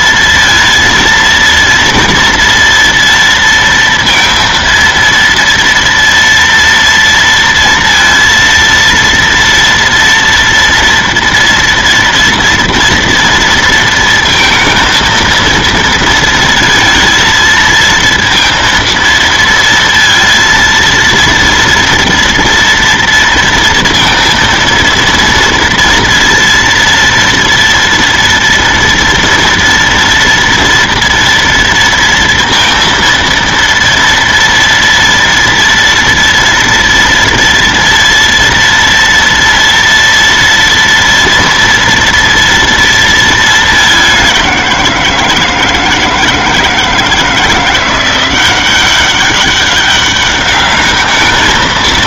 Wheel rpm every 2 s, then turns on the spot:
230, 230, 230, 230, 230, 240, 230, 230, 230, 230, 230, 230, 230, 230, 230, 230, 230, 240, 230, 230, 230, 230, 180, 160, 190, 210.
none